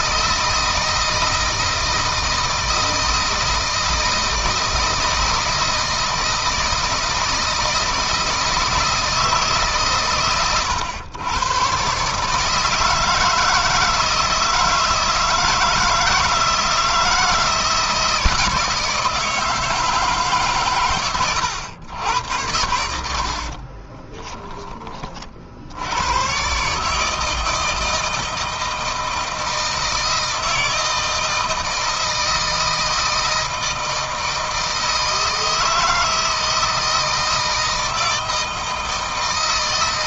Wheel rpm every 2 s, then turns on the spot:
160, 160, 160, 160, 160, 100, 160, 160, 160, 160, 130, 70, 30, 150, 160, 160, 160, 160, 160, 160.
none